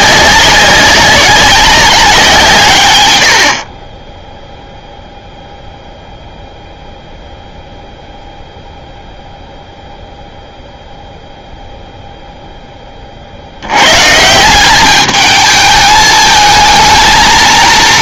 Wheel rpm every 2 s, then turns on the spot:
200, 140, 0, 0, 0, 0, 10, 180, 220.
none